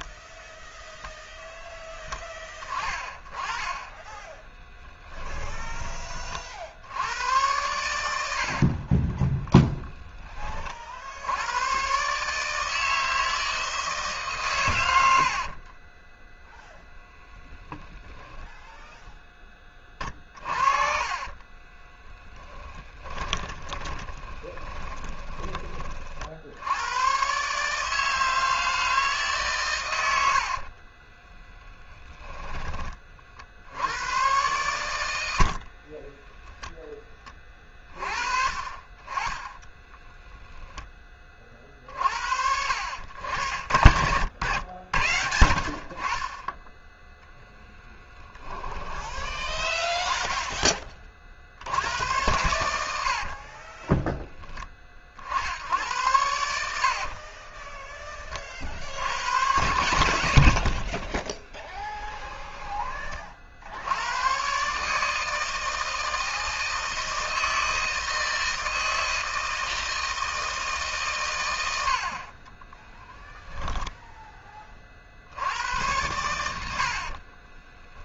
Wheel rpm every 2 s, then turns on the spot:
0, 20, 10, 80, 30, 50, 160, 90, 0, 0, 30, 20, 20, 100, 160, 40, 20, 130, 0, 40, 10, 80, 90, 10, 20, 30, 100, 40, 60, 70, 50, 20, 150, 160, 160, 140, 20, 30, 90.
4-6 8-10 20-26 30-32 60-62 72-74